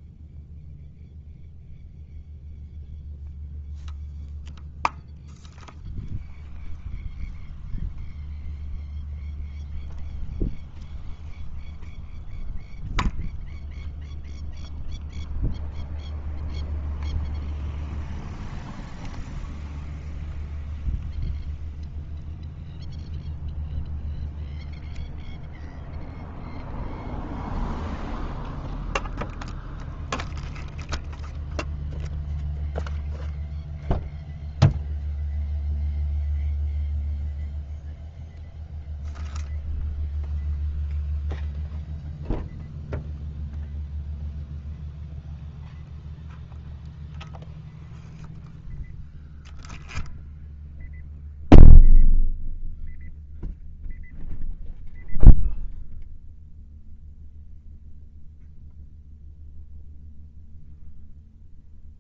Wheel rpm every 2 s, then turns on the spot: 0, 0, 0, 0, 0, 0, 0, 0, 0, 0, 0, 0, 0, 0, 0, 0, 0, 0, 0, 0, 0, 0, 0, 0, 0, 0, 0, 0, 0, 0, 0.
none